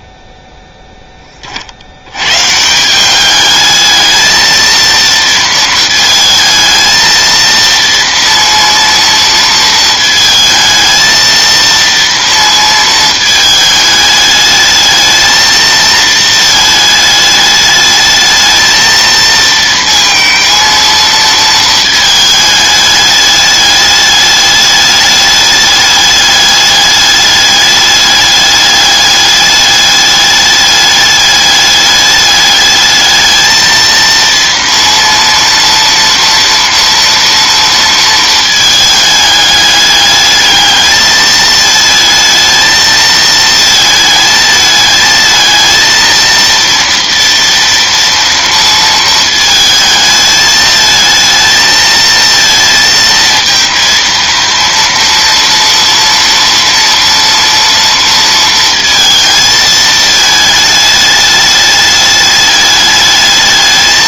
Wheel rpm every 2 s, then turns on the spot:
0, 160, 230, 220, 230, 220, 230, 220, 220, 220, 230, 210, 210, 210, 210, 210, 210, 230, 230, 220, 210, 220, 220, 230, 230, 220, 230, 230, 230, 230, 210, 210.
none